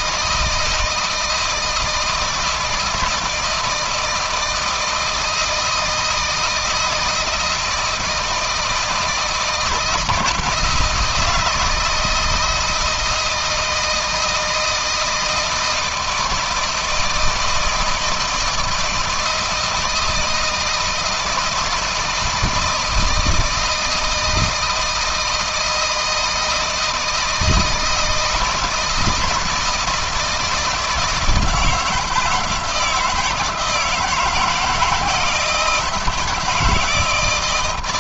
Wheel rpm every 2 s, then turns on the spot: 160, 160, 160, 160, 160, 170, 160, 160, 160, 160, 160, 160, 160, 160, 160, 160, 170, 160, 160.
none